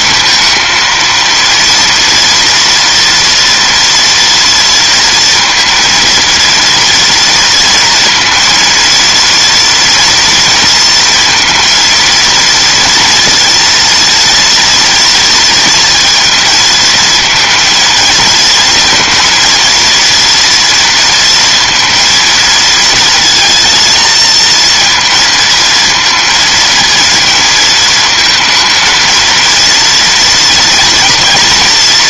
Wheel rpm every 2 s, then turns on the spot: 230, 240, 230, 230, 230, 230, 230, 230, 230, 230, 230, 220, 230, 230, 220, 230.
none